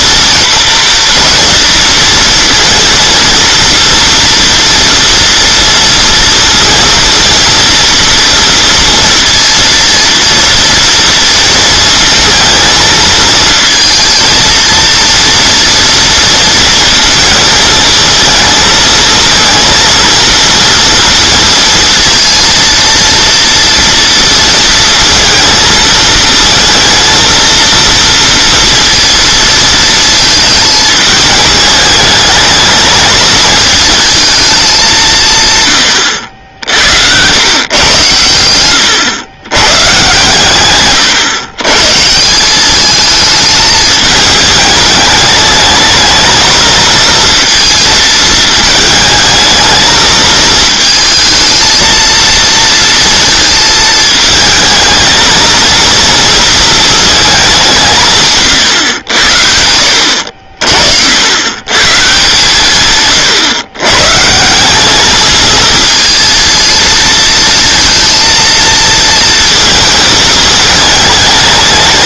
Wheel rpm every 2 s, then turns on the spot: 230, 230, 230, 230, 230, 230, 220, 230, 230, 220, 230, 230, 230, 220, 230, 220, 210, 210, 70, 100, 130, 190, 210, 220, 220, 220, 230, 220, 230, 130, 60, 140, 180, 230, 230, 210.
none